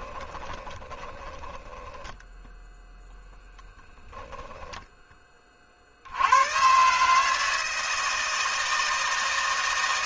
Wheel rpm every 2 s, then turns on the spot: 30, 0, 10, 140, 160.
0-2